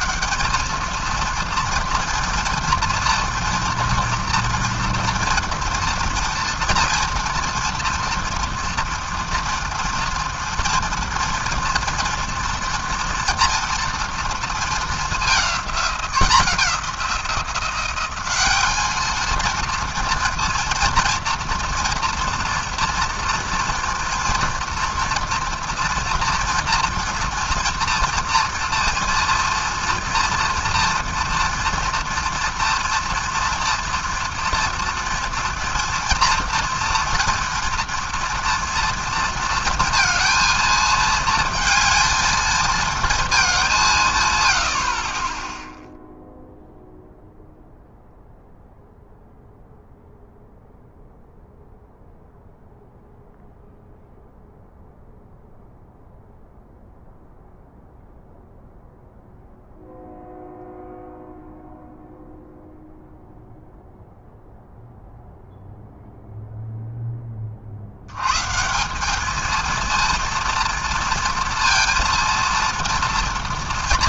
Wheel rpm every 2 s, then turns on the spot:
220, 230, 230, 240, 230, 230, 240, 220, 180, 210, 230, 230, 230, 240, 230, 230, 230, 240, 240, 230, 220, 230, 80, 0, 0, 0, 0, 0, 0, 0, 0, 0, 0, 0, 170, 230, 230.
none